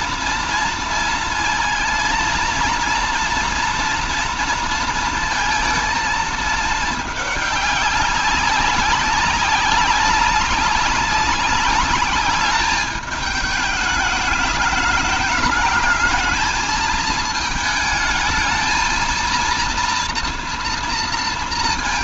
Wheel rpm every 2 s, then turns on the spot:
230, 230, 230, 220, 200, 200, 210, 210, 220, 220, 230.
none